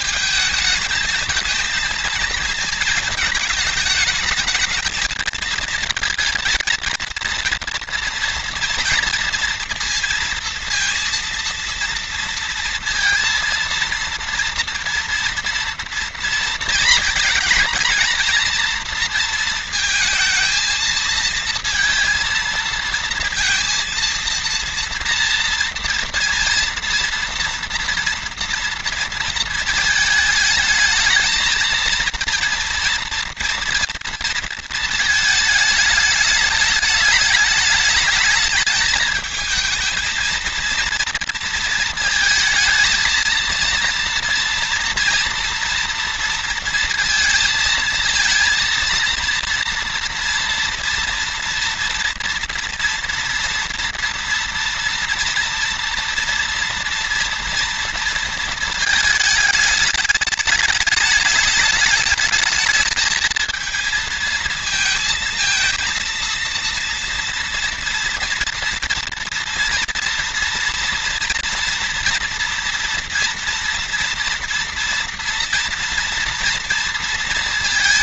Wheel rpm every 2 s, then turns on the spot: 220, 220, 220, 230, 230, 230, 230, 230, 230, 230, 230, 230, 230, 230, 230, 220, 230, 220, 210, 220, 230, 230, 230, 230, 230, 230, 230, 230, 230, 220, 210, 220, 220, 230, 230, 240, 240, 230, 230.
none